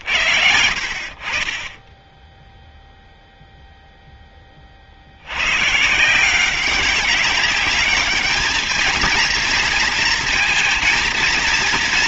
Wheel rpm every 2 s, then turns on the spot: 90, 0, 20, 170, 210, 230.
none